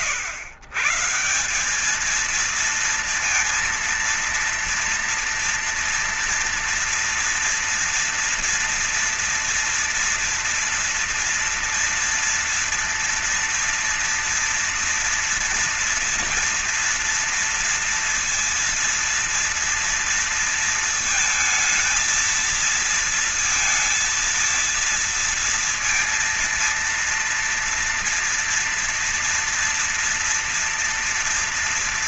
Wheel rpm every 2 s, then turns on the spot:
130, 220, 230, 230, 230, 230, 230, 230, 230, 230, 230, 230, 230, 230, 240, 230.
none